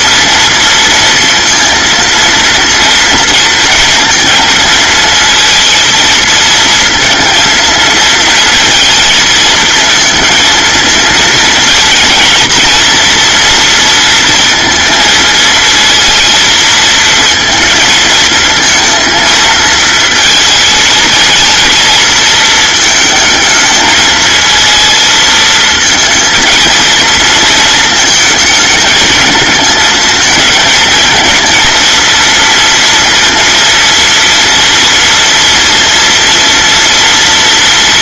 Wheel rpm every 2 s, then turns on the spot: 230, 230, 230, 230, 230, 230, 230, 230, 230, 230, 220, 220, 220, 230, 220, 220, 230, 230, 240.
none